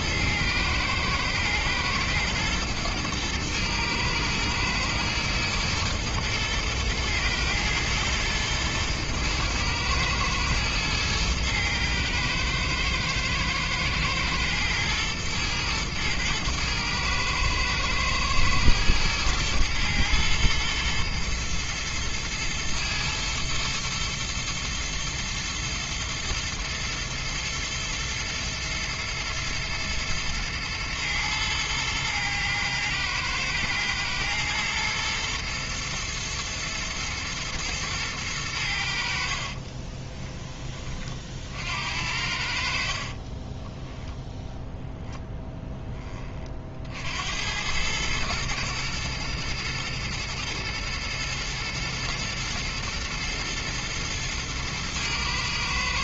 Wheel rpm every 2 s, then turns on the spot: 110, 120, 110, 110, 110, 110, 110, 110, 110, 110, 110, 120, 110, 110, 110, 110, 110, 110, 110, 70, 30, 50, 10, 60, 120, 110, 110, 120.
42-44